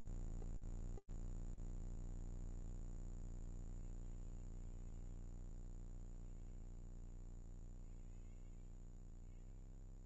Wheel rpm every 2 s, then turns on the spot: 10, 60, 40, 30, 0.
none